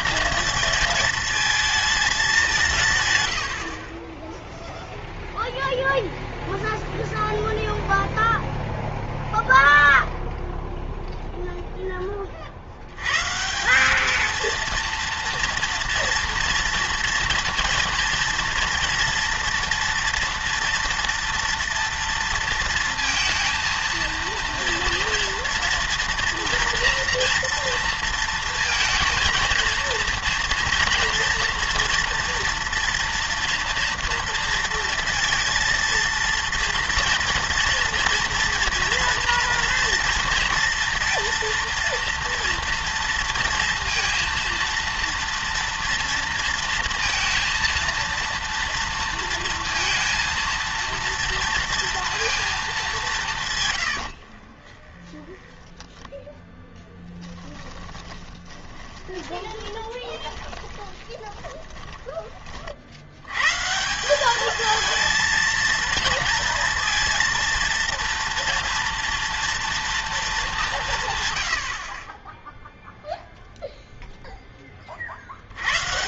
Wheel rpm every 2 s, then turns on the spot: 220, 170, 0, 0, 0, 0, 60, 230, 230, 230, 230, 230, 230, 230, 230, 240, 230, 230, 230, 230, 230, 240, 230, 230, 230, 230, 220, 40, 10, 30, 30, 50, 220, 230, 240, 180, 0, 20.
54-56 58-62